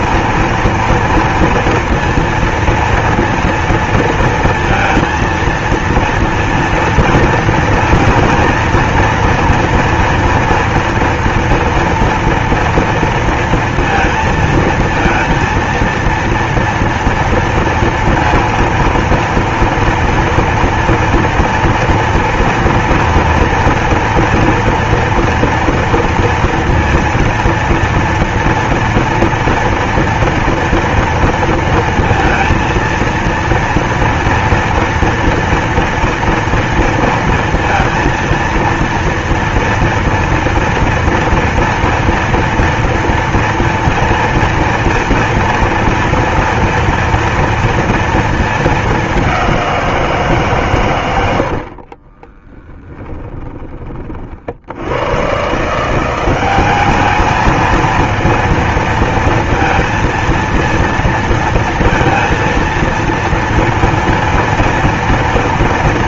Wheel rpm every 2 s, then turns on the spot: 230, 230, 230, 230, 230, 240, 230, 220, 230, 230, 230, 230, 230, 230, 230, 230, 230, 230, 230, 230, 230, 240, 230, 230, 210, 140, 10, 60, 200, 230, 230, 230, 230.
52-54